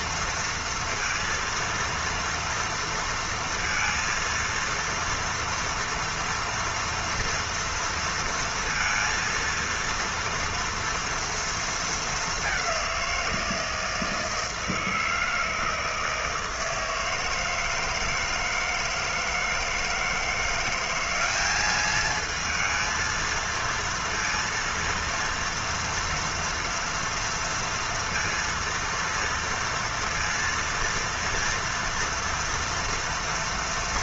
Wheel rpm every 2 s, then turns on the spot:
230, 230, 230, 230, 230, 230, 200, 160, 160, 160, 170, 220, 230, 230, 230, 230, 230.
none